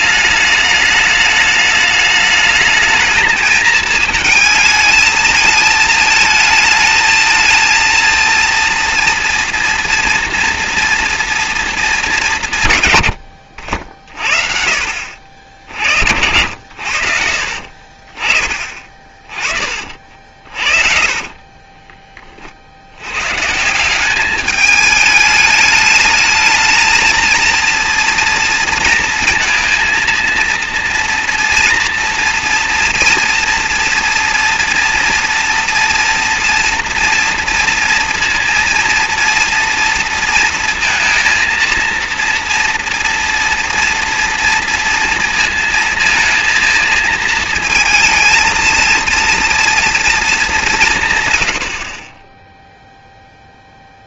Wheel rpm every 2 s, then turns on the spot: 210, 220, 220, 220, 230, 230, 130, 60, 70, 30, 50, 70, 210, 220, 230, 230, 230, 230, 230, 230, 230, 240, 230, 230, 230, 190, 0.
20-22